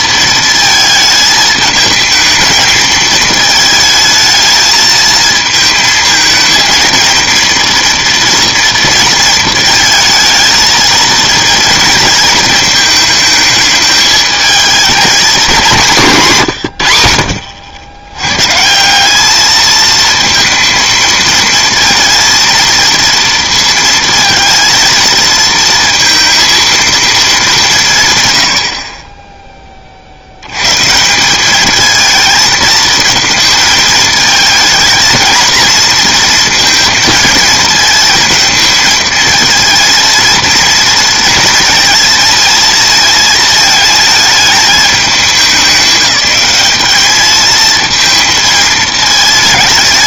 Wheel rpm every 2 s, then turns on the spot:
220, 220, 220, 230, 230, 220, 220, 220, 100, 170, 220, 230, 230, 230, 60, 130, 220, 220, 230, 220, 230, 230, 220, 210, 220.
none